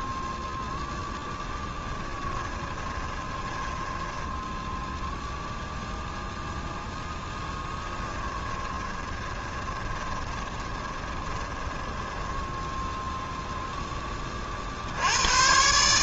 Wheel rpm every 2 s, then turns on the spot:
10, 20, 0, 10, 20, 20, 0, 60.
2-4 8-12